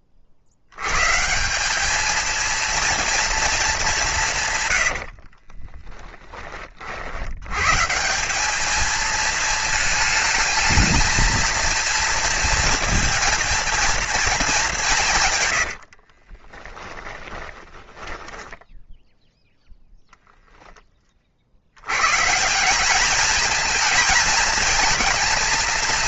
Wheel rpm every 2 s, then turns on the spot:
110, 230, 90, 50, 220, 220, 230, 180, 20, 10, 20, 200, 230.
4-6 16-18